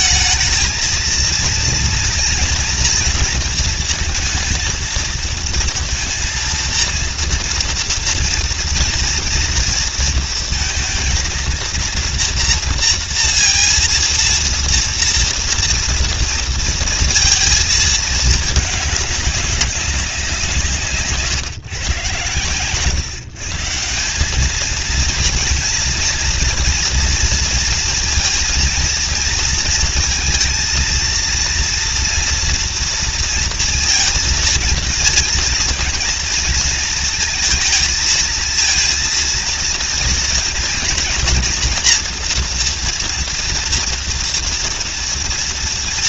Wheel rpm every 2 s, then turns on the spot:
220, 240, 230, 230, 230, 230, 230, 230, 230, 210, 160, 130, 210, 230, 230, 230, 230, 230, 230, 230, 230, 240, 230.
none